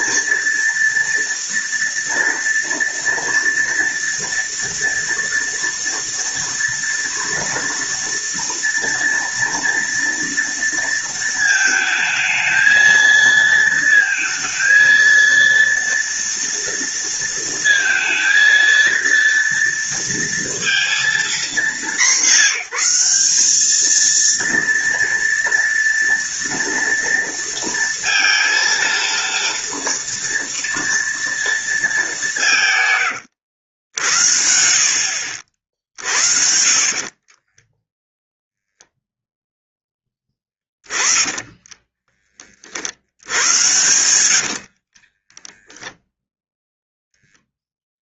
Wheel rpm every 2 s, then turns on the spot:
230, 230, 240, 230, 230, 230, 220, 230, 230, 230, 230, 200, 230, 230, 230, 230, 160, 60, 50, 0, 10, 40, 70, 0.
36-38 40-42 44-46